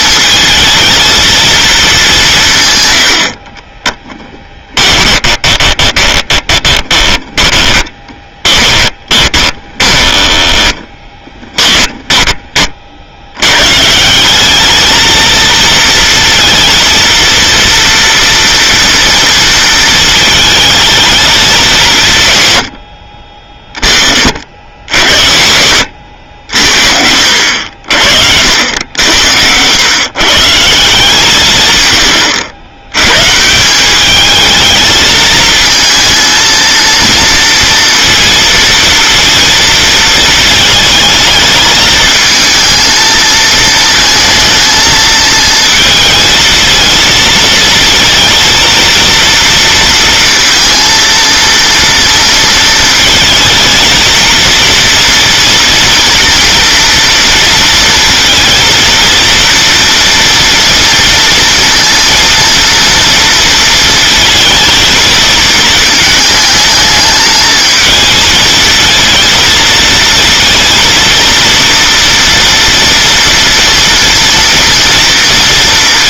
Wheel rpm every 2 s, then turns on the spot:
220, 130, 20, 20, 10, 20, 30, 210, 230, 230, 220, 90, 60, 60, 80, 160, 100, 220, 230, 230, 220, 220, 230, 230, 230, 230, 230, 230, 230, 230, 230, 230, 220, 220, 220, 230, 230, 230.
4-12